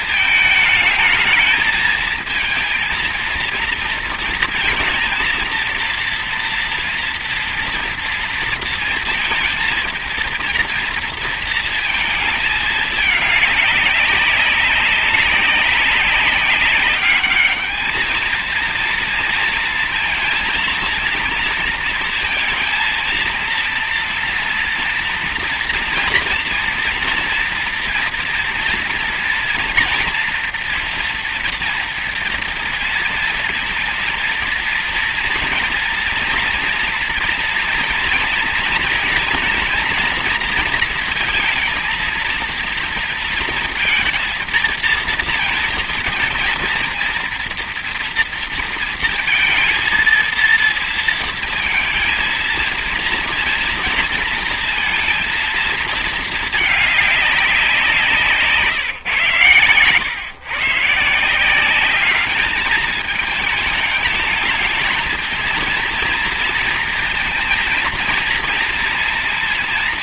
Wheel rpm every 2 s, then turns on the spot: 220, 230, 230, 230, 230, 230, 210, 200, 200, 230, 230, 230, 230, 230, 240, 240, 230, 230, 230, 230, 230, 230, 230, 230, 230, 230, 230, 230, 200, 130, 150, 210, 220, 230, 230.
none